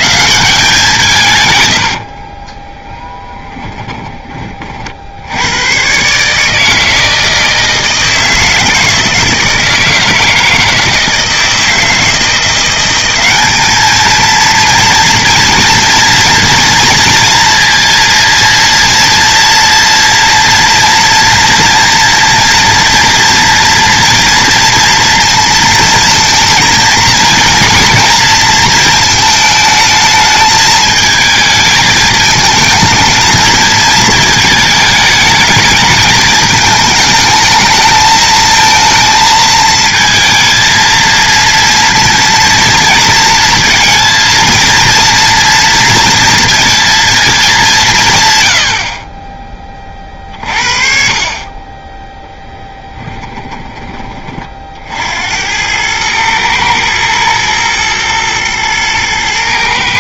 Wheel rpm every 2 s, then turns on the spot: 170, 10, 60, 160, 160, 160, 180, 230, 230, 230, 230, 240, 230, 230, 220, 220, 220, 220, 220, 220, 230, 230, 230, 230, 70, 40, 10, 60, 110, 110.
2-4 52-54